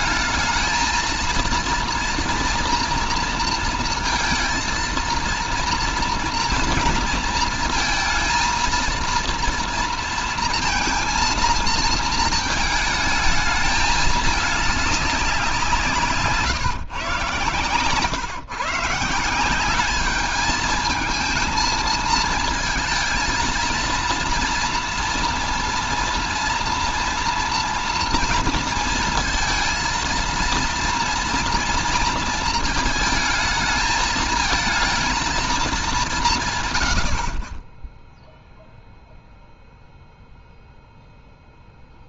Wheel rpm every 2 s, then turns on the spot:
230, 230, 230, 230, 230, 230, 220, 200, 130, 150, 220, 220, 230, 230, 230, 230, 230, 220, 120, 0, 0.
none